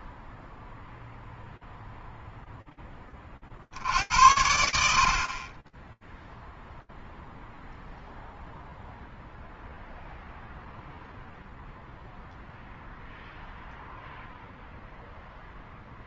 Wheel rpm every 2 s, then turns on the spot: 0, 60, 30, 0, 0, 0, 0, 0.
none